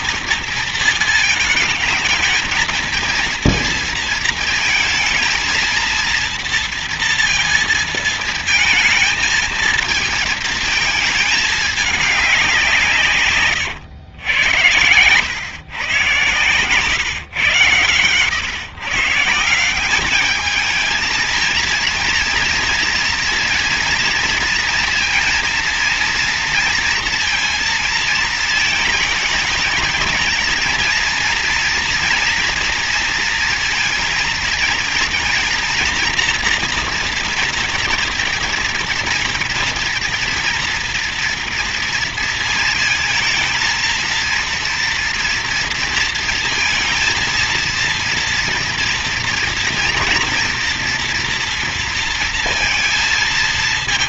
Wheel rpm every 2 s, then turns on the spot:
230, 230, 220, 230, 220, 220, 150, 100, 120, 140, 220, 230, 230, 230, 220, 230, 230, 230, 230, 230, 230, 230, 230, 230, 230, 240, 230.
none